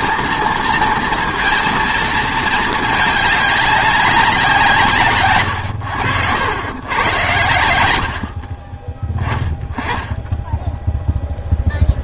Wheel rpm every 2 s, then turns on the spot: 230, 220, 160, 100, 30, 10.
none